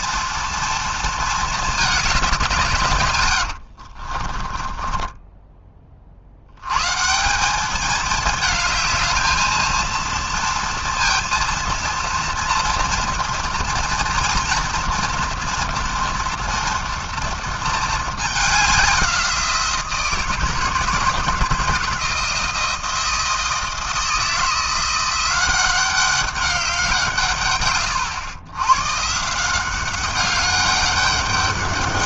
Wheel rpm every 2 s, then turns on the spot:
230, 220, 60, 40, 210, 230, 230, 230, 230, 220, 170, 160, 160, 190, 110, 190.
4-6